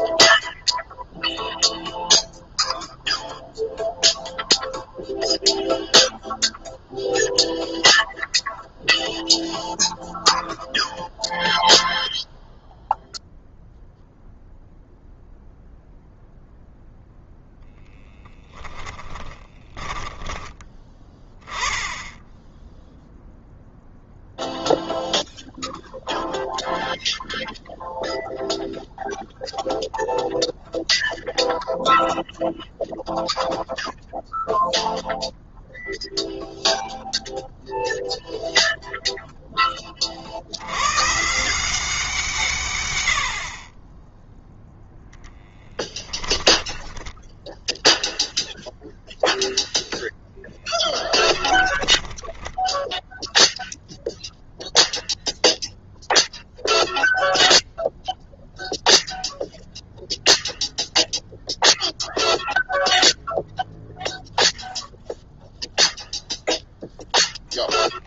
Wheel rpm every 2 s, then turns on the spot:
0, 0, 0, 0, 0, 0, 0, 0, 0, 10, 20, 0, 0, 0, 0, 0, 0, 0, 0, 0, 120, 100, 0, 10, 0, 10, 0, 0, 0, 0, 0, 0, 0, 0.
18-20